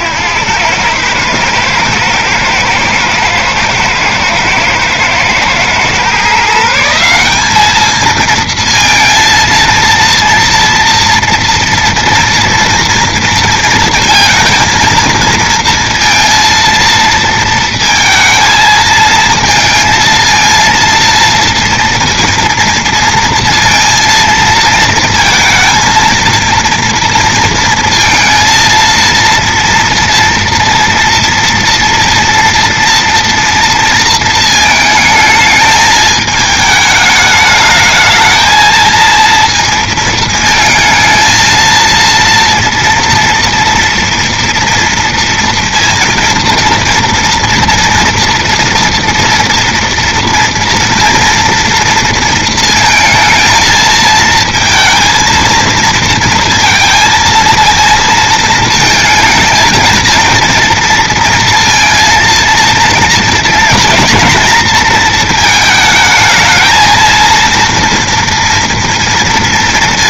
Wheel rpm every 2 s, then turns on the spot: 70, 110, 110, 130, 220, 230, 230, 230, 230, 230, 230, 230, 230, 230, 230, 230, 230, 230, 220, 220, 230, 230, 230, 230, 230, 230, 230, 220, 230, 230, 230, 230, 230, 220, 230.
none